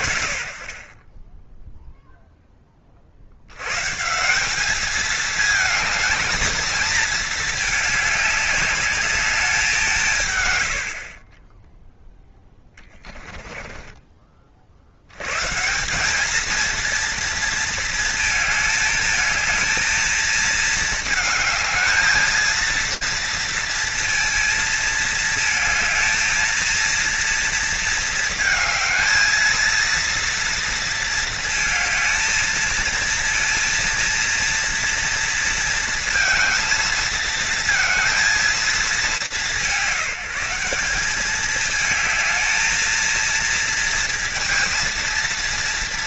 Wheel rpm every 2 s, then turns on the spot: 30, 40, 210, 220, 210, 50, 20, 120, 230, 220, 220, 230, 220, 230, 220, 230, 230, 230, 230, 200, 200, 220, 230.
12-14